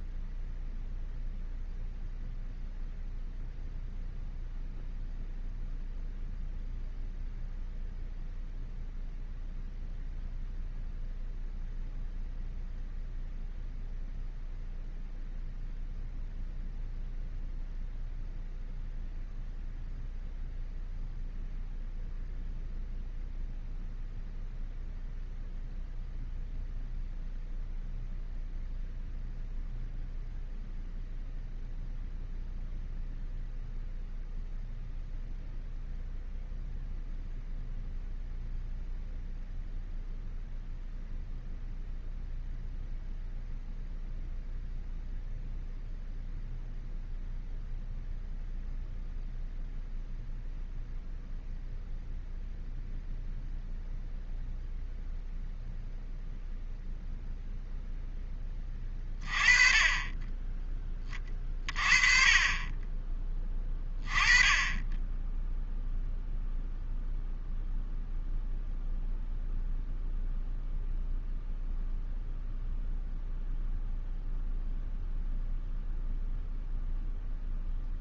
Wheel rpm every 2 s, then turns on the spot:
0, 0, 0, 0, 0, 0, 0, 0, 0, 0, 0, 0, 0, 0, 0, 0, 0, 0, 0, 0, 0, 0, 0, 0, 0, 0, 0, 0, 0, 20, 10, 20, 10, 0, 0, 0, 0, 0, 0.
none